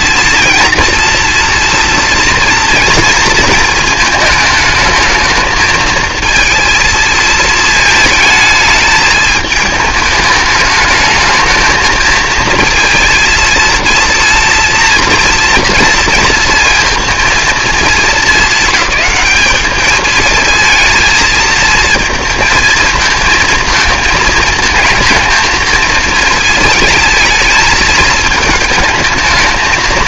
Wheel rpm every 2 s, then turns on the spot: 230, 230, 220, 230, 220, 210, 230, 230, 230, 220, 230, 220, 220, 220, 220.
none